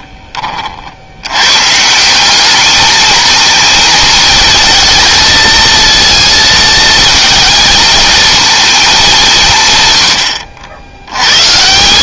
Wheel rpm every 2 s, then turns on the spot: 60, 220, 220, 220, 200, 80.
none